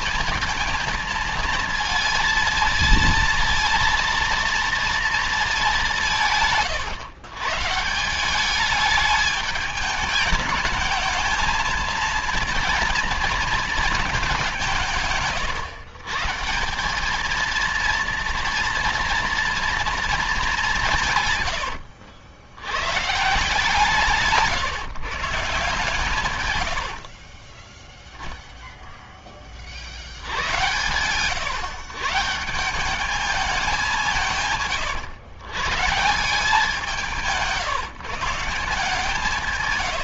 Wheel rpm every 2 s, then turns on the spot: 230, 230, 230, 130, 190, 210, 230, 190, 160, 230, 200, 100, 140, 110, 0, 100, 170, 170, 180, 150.
26-28